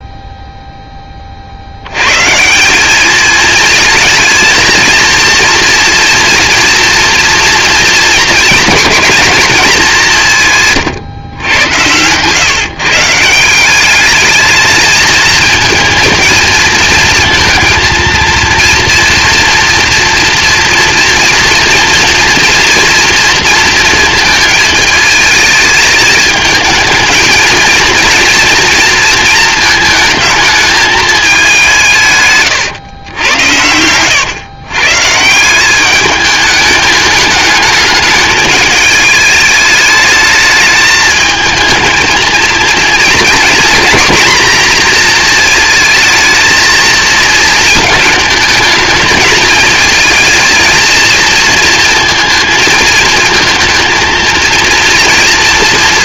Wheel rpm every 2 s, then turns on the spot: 0, 170, 220, 240, 240, 140, 140, 220, 220, 230, 240, 230, 220, 220, 240, 220, 130, 130, 210, 220, 210, 230, 240, 220, 220, 220, 230, 230.
10-12